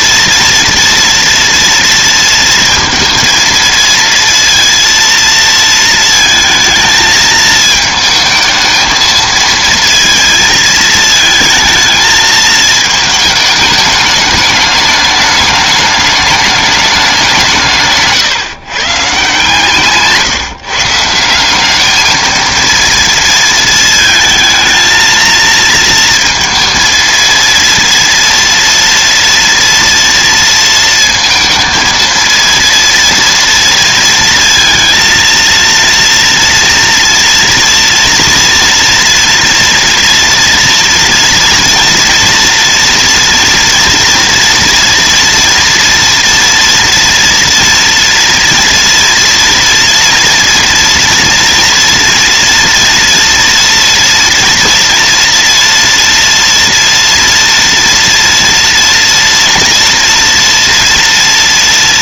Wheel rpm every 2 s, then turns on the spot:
230, 230, 230, 220, 220, 220, 220, 210, 210, 140, 140, 230, 220, 230, 230, 230, 230, 230, 230, 230, 230, 230, 230, 230, 230, 230, 230, 230, 230, 230, 230.
none